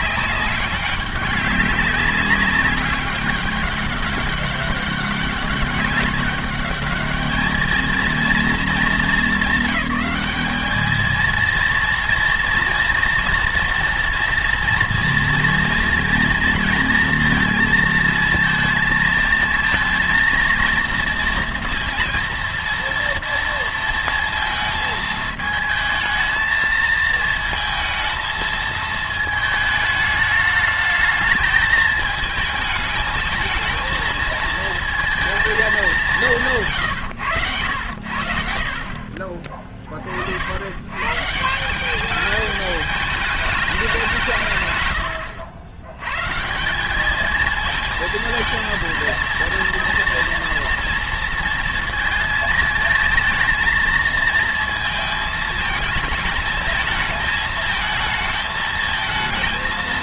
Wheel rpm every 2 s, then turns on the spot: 200, 200, 200, 200, 210, 210, 240, 240, 230, 230, 230, 230, 220, 220, 220, 210, 220, 220, 150, 70, 90, 210, 150, 170, 230, 230, 220, 230, 220, 220.
none